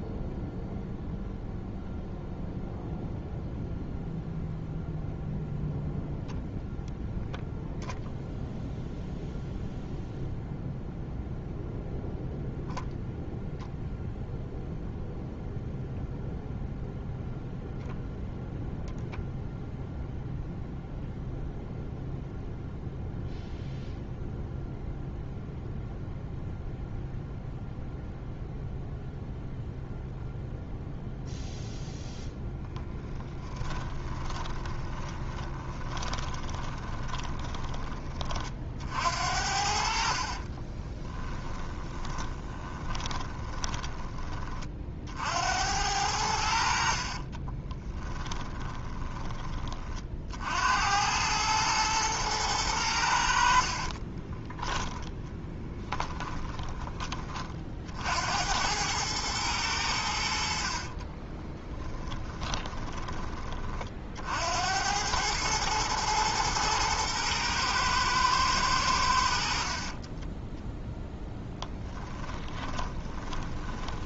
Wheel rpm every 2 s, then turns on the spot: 0, 0, 0, 0, 0, 0, 0, 0, 0, 0, 0, 0, 0, 0, 0, 0, 10, 20, 20, 60, 10, 20, 60, 50, 20, 90, 90, 10, 20, 100, 40, 20, 90, 120, 90, 10, 30.
32-38 40-44 46-50 54-56 60-62 70-74